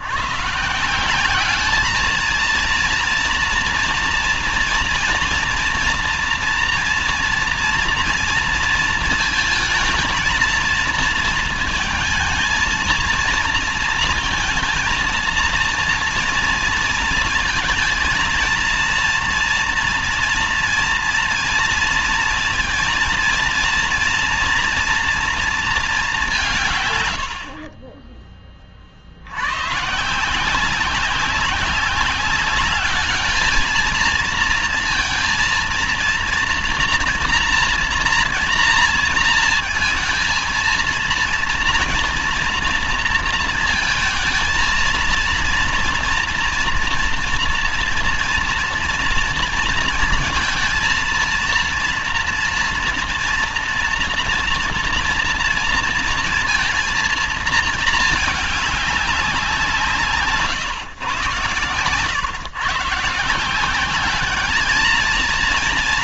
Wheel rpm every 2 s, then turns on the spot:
150, 230, 230, 230, 230, 230, 230, 230, 230, 230, 230, 230, 240, 160, 30, 180, 200, 230, 230, 230, 230, 230, 230, 230, 230, 230, 230, 230, 230, 210, 140, 130, 210.
none